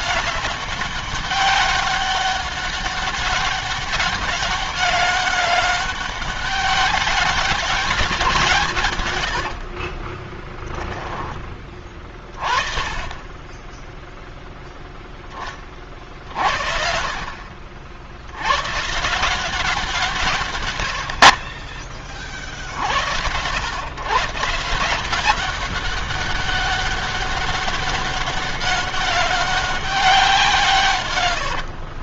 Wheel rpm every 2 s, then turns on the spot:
190, 200, 200, 200, 170, 10, 30, 0, 50, 110, 140, 60, 160, 200, 200, 150.
none